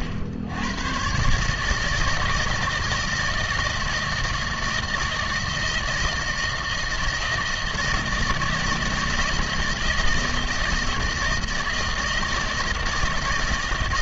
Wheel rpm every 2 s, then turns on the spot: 100, 160, 160, 160, 160, 160, 160.
none